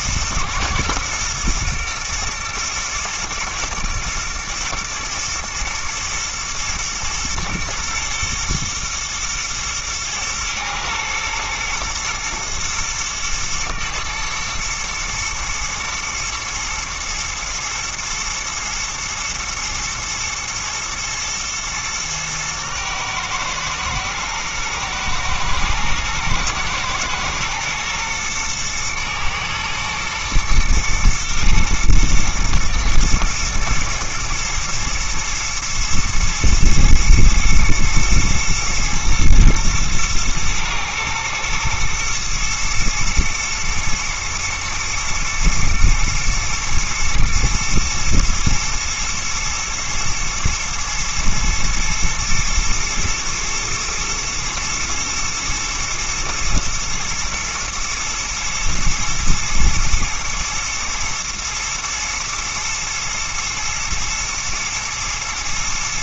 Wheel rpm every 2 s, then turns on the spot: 120, 120, 110, 120, 120, 120, 110, 120, 110, 120, 120, 110, 110, 110, 110, 110, 110, 120, 110, 120, 110, 110, 110, 110, 110, 110, 120, 110, 110, 110, 110, 110, 110.
none